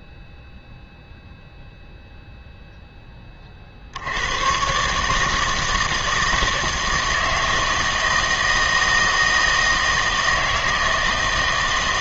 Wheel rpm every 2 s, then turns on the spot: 0, 0, 120, 160, 160, 160.
none